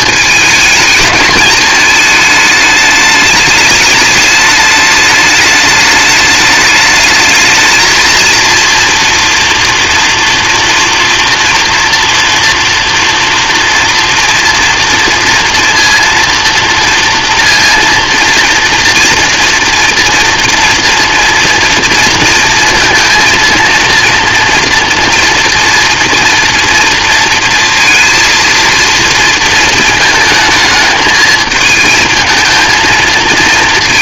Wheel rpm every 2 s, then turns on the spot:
220, 210, 210, 210, 230, 230, 230, 230, 230, 230, 230, 230, 230, 230, 230, 220, 220.
none